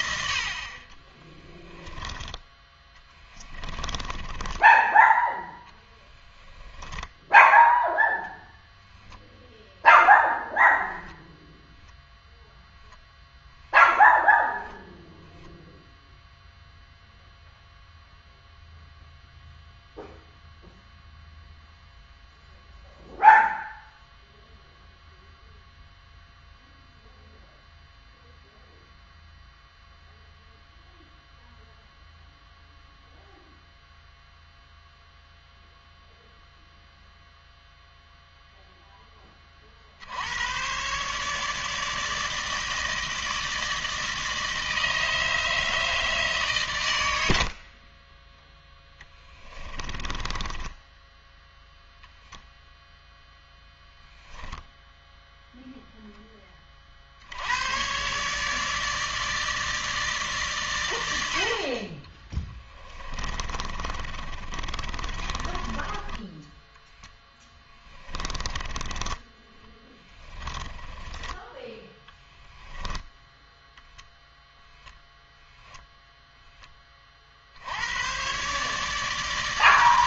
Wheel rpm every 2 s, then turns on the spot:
60, 20, 10, 10, 0, 10, 0, 0, 0, 0, 0, 0, 0, 0, 0, 0, 0, 0, 0, 0, 100, 160, 160, 130, 10, 10, 0, 0, 20, 150, 140, 20, 30, 10, 20, 10, 10, 0, 10, 140.
4-8 10-12 50-52 62-68 70-74